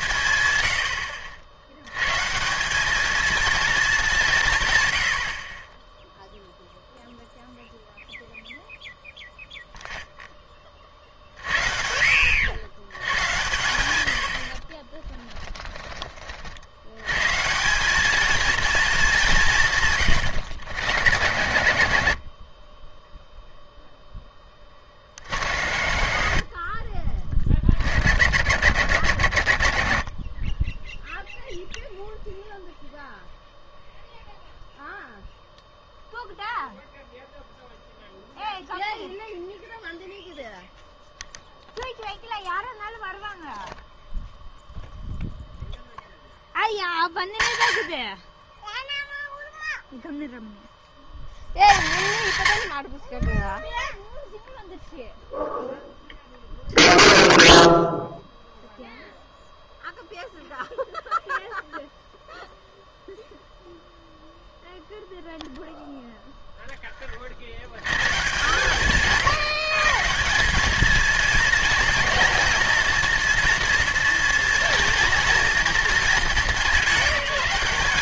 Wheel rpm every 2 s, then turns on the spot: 110, 190, 130, 0, 0, 30, 110, 30, 100, 230, 80, 10, 30, 30, 80, 10, 0, 0, 0, 0, 0, 0, 0, 30, 10, 50, 80, 0, 0, 0, 0, 0, 0, 10, 140, 220, 230, 230, 200.
14-16 26-28